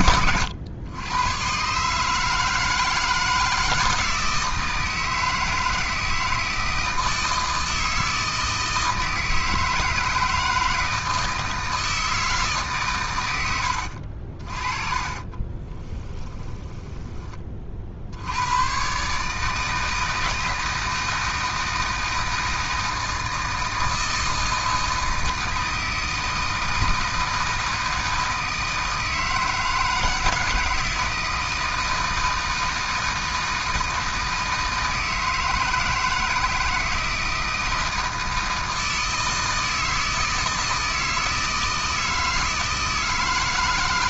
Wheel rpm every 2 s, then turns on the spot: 110, 160, 160, 160, 160, 160, 140, 30, 10, 120, 160, 160, 160, 160, 160, 160, 160, 160, 160, 160, 160, 160.
14-18